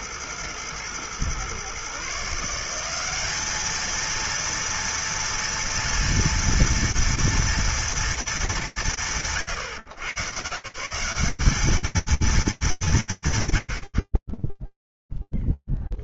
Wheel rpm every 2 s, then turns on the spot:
100, 130, 210, 230, 230, 140, 210, 90.
none